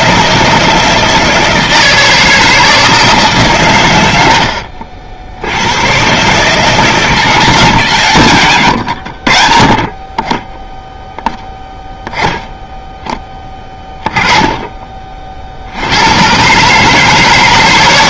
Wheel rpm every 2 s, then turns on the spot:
160, 160, 60, 160, 90, 0, 10, 20, 150.
8-10